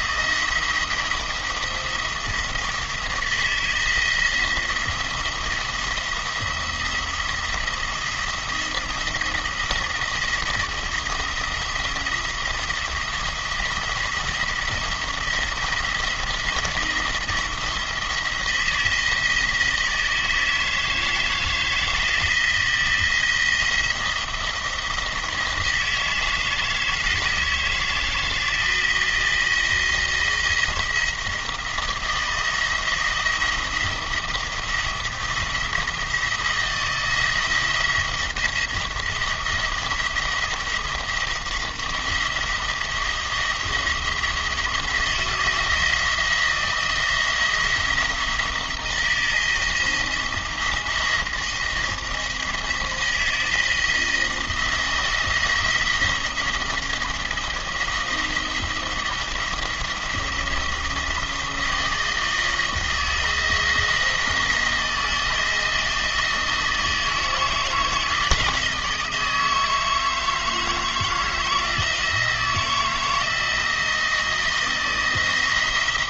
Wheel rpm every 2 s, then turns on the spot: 170, 160, 170, 170, 170, 160, 170, 170, 170, 170, 160, 170, 170, 160, 170, 170, 170, 170, 170, 170, 170, 160, 170, 170, 170, 170, 170, 160, 170, 170, 170, 160, 170, 160, 160, 160, 170, 170.
none